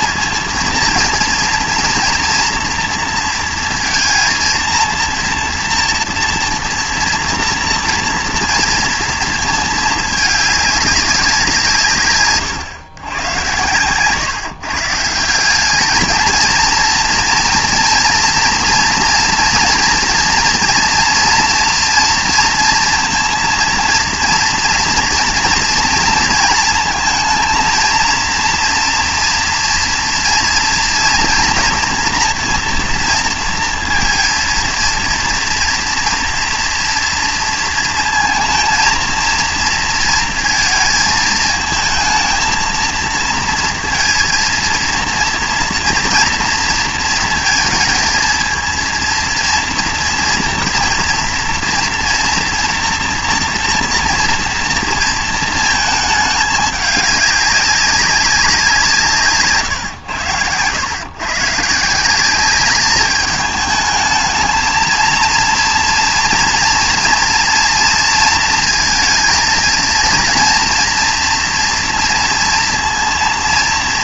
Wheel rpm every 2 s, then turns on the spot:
230, 230, 230, 230, 230, 210, 130, 150, 220, 230, 230, 230, 240, 230, 230, 240, 230, 230, 240, 230, 230, 220, 230, 230, 230, 240, 230, 230, 210, 180, 100, 200, 220, 230, 230, 230, 230.
none